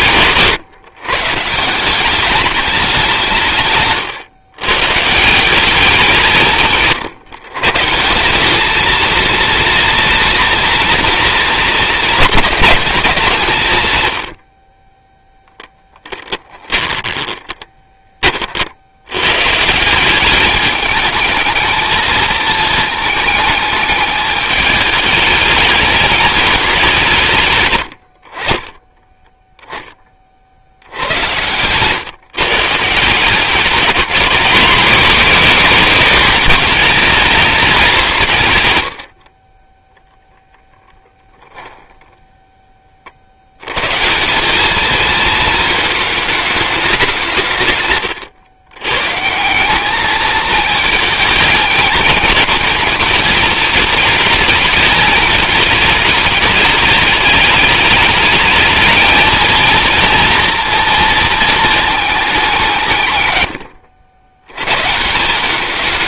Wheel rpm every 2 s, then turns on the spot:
130, 190, 130, 150, 230, 230, 210, 20, 20, 80, 210, 220, 210, 200, 20, 80, 160, 240, 220, 100, 0, 30, 220, 190, 140, 220, 220, 220, 210, 220, 230, 160, 130.
16-18 28-30